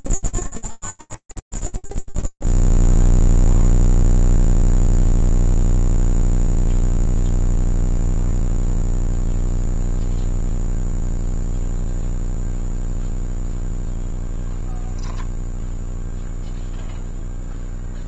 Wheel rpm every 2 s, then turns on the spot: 0, 0, 0, 0, 0, 0, 0, 0, 0.
none